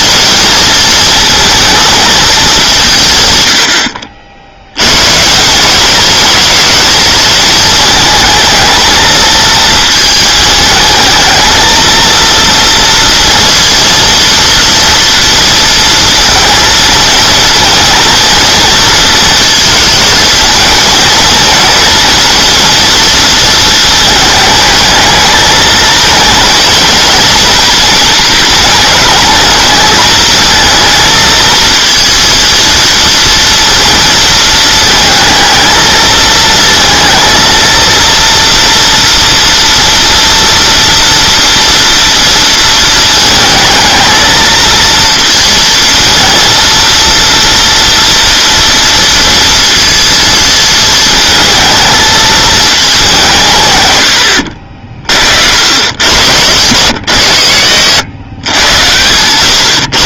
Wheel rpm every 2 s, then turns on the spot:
220, 190, 100, 220, 220, 220, 230, 230, 230, 230, 220, 230, 220, 230, 220, 220, 230, 220, 220, 230, 230, 230, 230, 230, 230, 230, 210, 40, 120, 120.
none